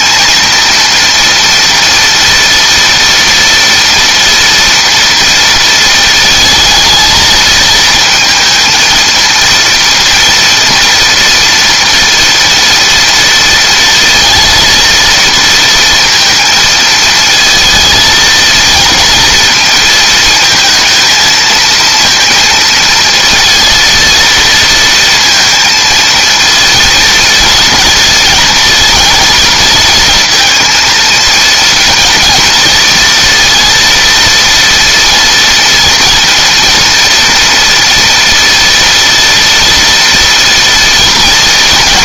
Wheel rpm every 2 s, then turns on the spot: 230, 230, 230, 220, 230, 230, 230, 230, 220, 220, 230, 230, 230, 230, 220, 230, 230, 230, 230, 230, 230.
none